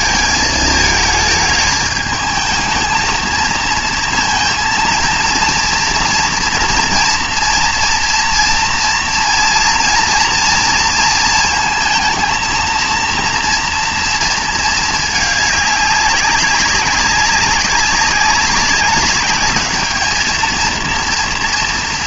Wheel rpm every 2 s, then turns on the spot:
220, 220, 230, 230, 230, 230, 230, 220, 190, 200, 230.
none